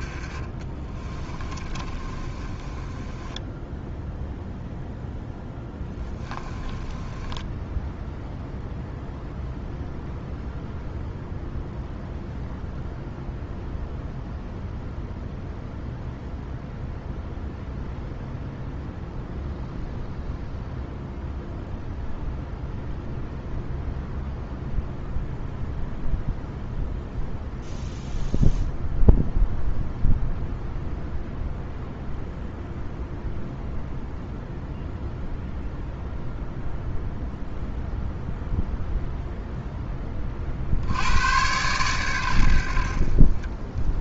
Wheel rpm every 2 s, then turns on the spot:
30, 20, 0, 10, 0, 0, 0, 0, 0, 0, 0, 0, 0, 0, 0, 0, 0, 0, 0, 0, 80, 60.
0-4 6-8